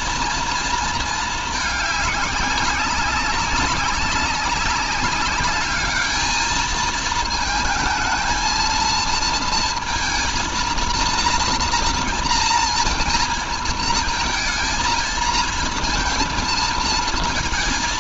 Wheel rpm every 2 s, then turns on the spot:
230, 200, 200, 220, 220, 230, 240, 220, 220.
none